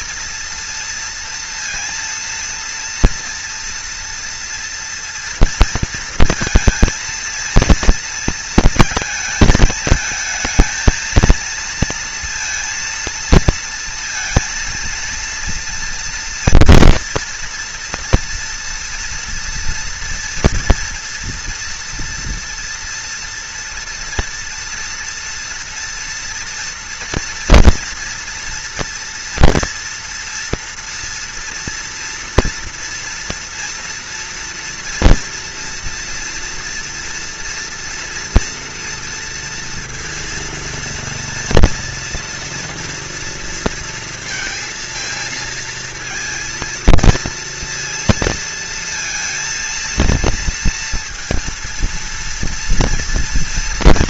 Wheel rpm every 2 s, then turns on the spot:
230, 230, 230, 230, 230, 220, 230, 230, 230, 230, 230, 230, 240, 230, 230, 230, 240, 230, 230, 230, 230, 230, 230, 230, 230, 230, 230.
none